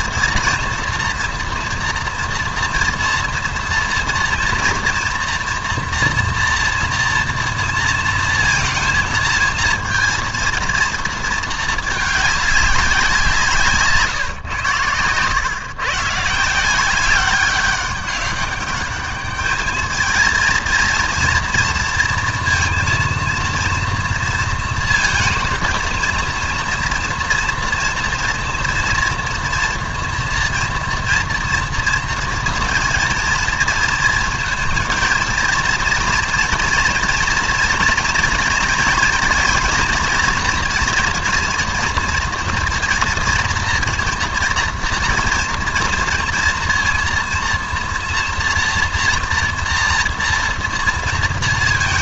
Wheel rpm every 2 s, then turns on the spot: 230, 230, 240, 240, 230, 230, 200, 110, 180, 200, 230, 230, 230, 230, 230, 230, 230, 230, 230, 230, 230, 230, 230, 230, 240, 230.
none